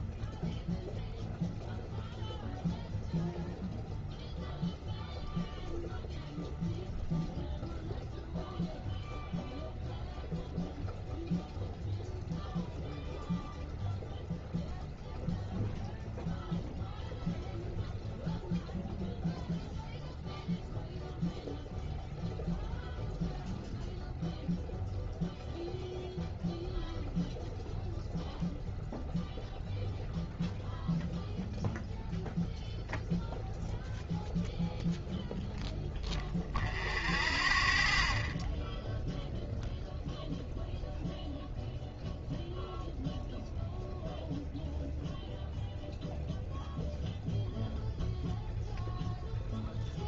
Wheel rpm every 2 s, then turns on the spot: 0, 0, 0, 0, 0, 0, 0, 0, 0, 0, 0, 0, 0, 0, 0, 0, 0, 0, 0, 0, 0, 0, 0, 0, 0.
none